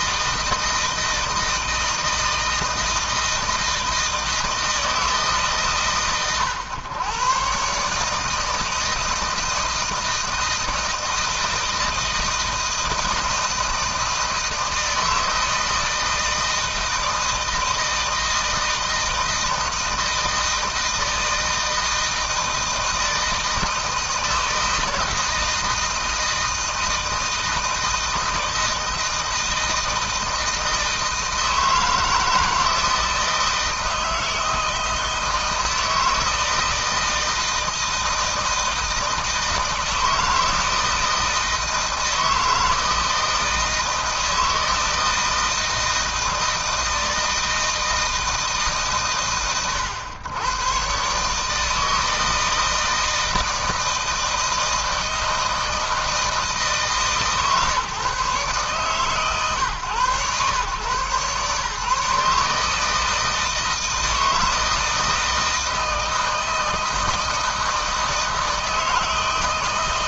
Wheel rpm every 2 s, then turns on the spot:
160, 160, 160, 120, 160, 160, 160, 160, 160, 160, 160, 160, 160, 160, 160, 160, 160, 160, 160, 160, 160, 160, 160, 160, 130, 130, 160, 160, 160, 140, 110, 160, 160, 160, 160.
none